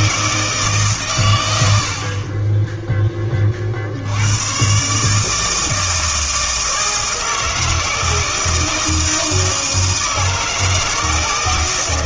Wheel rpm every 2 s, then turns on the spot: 150, 10, 140, 160, 160, 160.
none